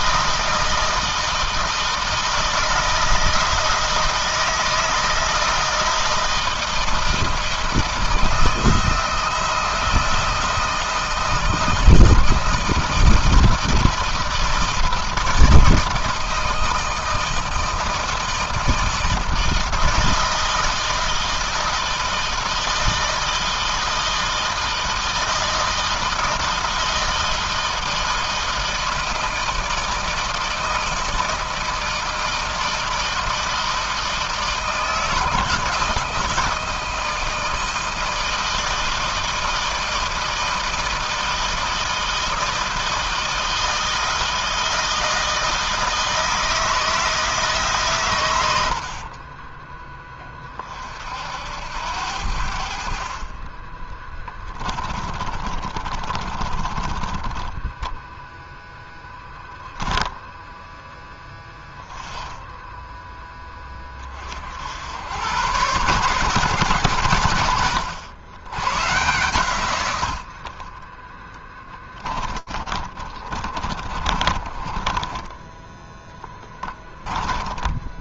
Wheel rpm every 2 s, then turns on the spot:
160, 160, 160, 160, 160, 160, 160, 160, 160, 160, 160, 160, 160, 160, 160, 160, 160, 160, 160, 160, 160, 160, 160, 160, 70, 50, 50, 20, 30, 0, 10, 10, 70, 120, 120, 10, 30, 20, 20.
48-50 54-58 72-74 76-78